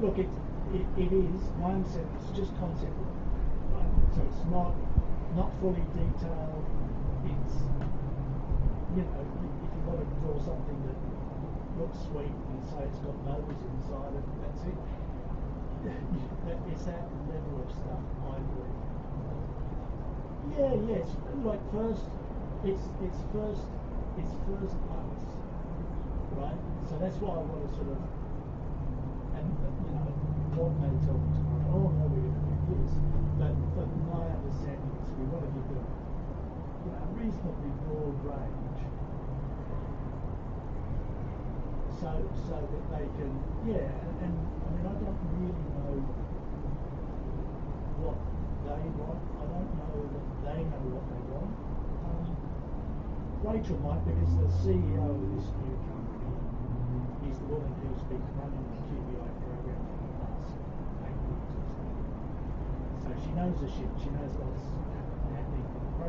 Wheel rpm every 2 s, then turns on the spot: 0, 0, 0, 0, 0, 0, 0, 0, 0, 0, 0, 0, 0, 0, 0, 0, 0, 0, 0, 0, 0, 0, 0, 0, 0, 0, 0, 0, 0, 0, 0, 0, 0.
none